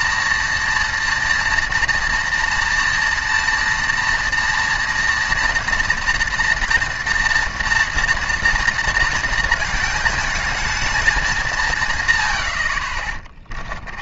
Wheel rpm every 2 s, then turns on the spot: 230, 230, 230, 240, 230, 220, 60.
none